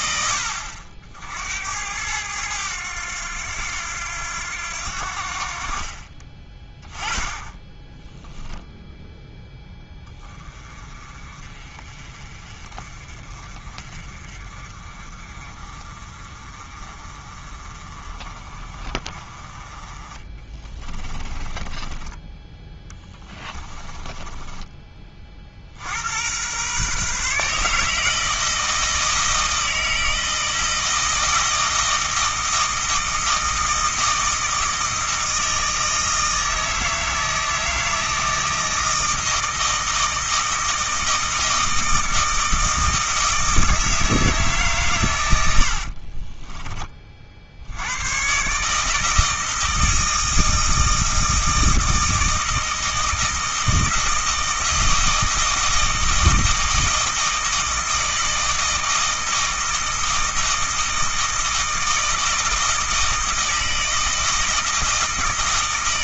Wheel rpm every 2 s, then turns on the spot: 60, 100, 80, 10, 0, 30, 30, 30, 30, 40, 20, 10, 20, 130, 160, 160, 160, 160, 160, 160, 160, 160, 130, 30, 150, 160, 160, 160, 160, 160, 160, 160, 160.
20-24